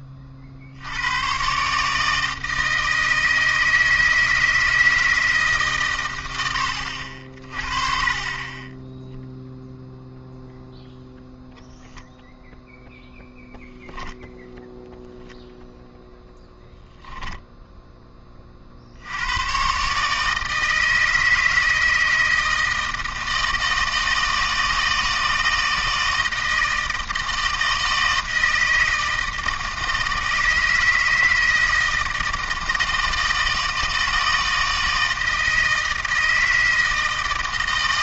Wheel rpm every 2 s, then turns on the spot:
70, 160, 160, 80, 10, 0, 0, 0, 0, 60, 160, 160, 160, 160, 160, 160, 160, 160, 160.
none